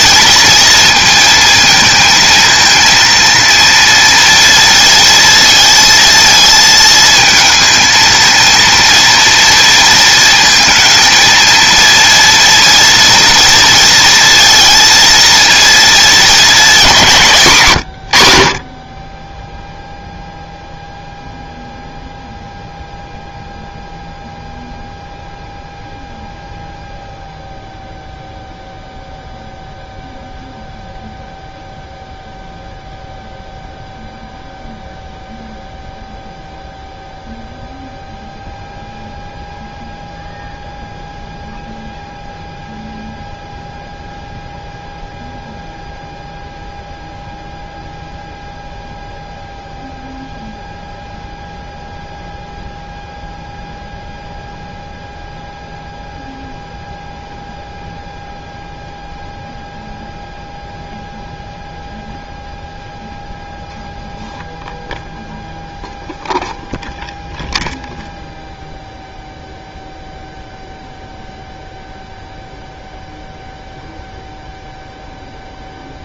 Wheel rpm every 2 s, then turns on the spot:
220, 220, 230, 220, 230, 220, 230, 230, 210, 60, 0, 0, 0, 0, 0, 0, 0, 0, 0, 0, 0, 0, 0, 0, 0, 0, 0, 0, 0, 0, 0, 0, 0, 0, 0, 0, 0, 0.
none